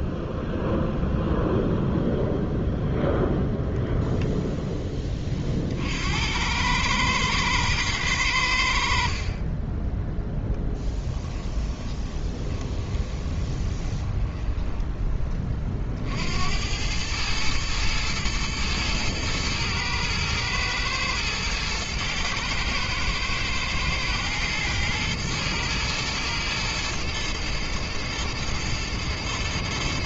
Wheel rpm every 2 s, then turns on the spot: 0, 0, 10, 110, 60, 10, 20, 10, 100, 110, 120, 110, 120, 110, 110.
10-14